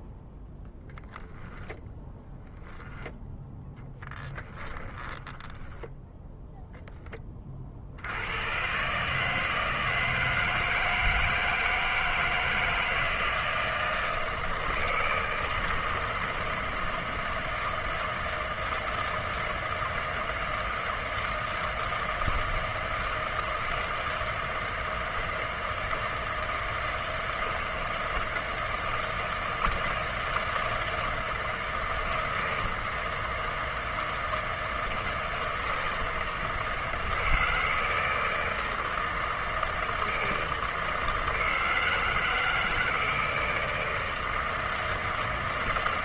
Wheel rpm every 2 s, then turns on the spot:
0, 10, 30, 10, 140, 160, 160, 160, 160, 160, 160, 160, 160, 160, 160, 160, 160, 160, 160, 160, 160, 160, 160.
4-6